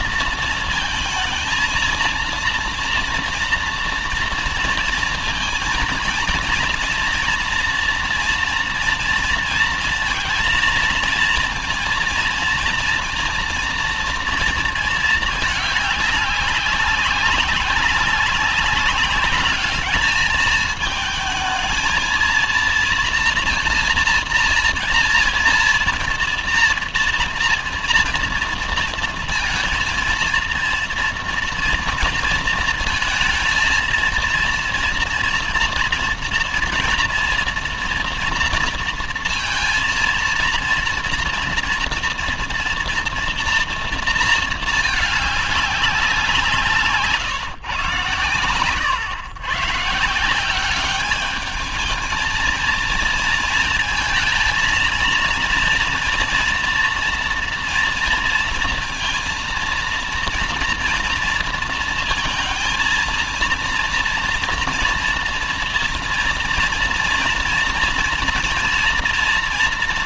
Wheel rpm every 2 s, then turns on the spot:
230, 230, 230, 230, 230, 230, 230, 230, 200, 200, 220, 230, 230, 230, 230, 230, 230, 240, 230, 230, 230, 240, 220, 170, 110, 190, 230, 230, 230, 230, 230, 230, 230, 230, 240.
none